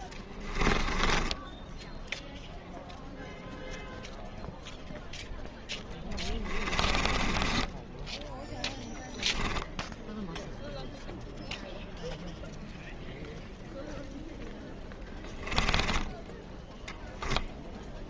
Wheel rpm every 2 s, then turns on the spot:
20, 0, 0, 20, 10, 0, 0, 10, 10.
0-2 6-10 14-16